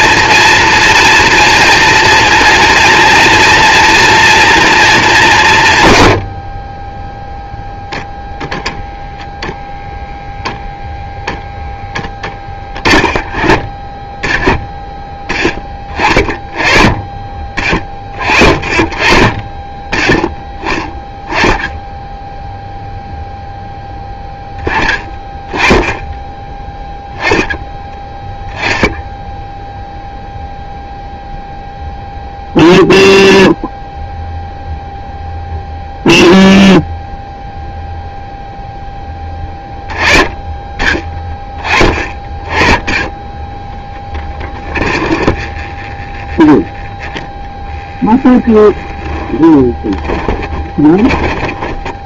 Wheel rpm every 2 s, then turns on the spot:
230, 230, 230, 40, 0, 0, 10, 10, 20, 40, 0, 0, 10, 10, 10, 0, 0, 0, 0, 0, 20, 20, 20, 10, 20, 20.
44-46 48-52